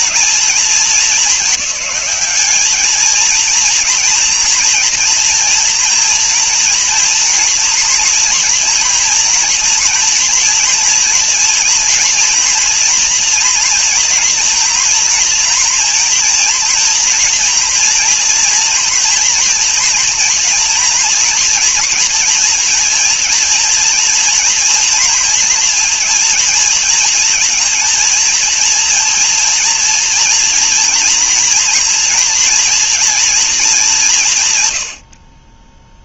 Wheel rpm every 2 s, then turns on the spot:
220, 210, 230, 230, 230, 230, 230, 230, 230, 230, 230, 230, 230, 220, 230, 230, 230, 100.
none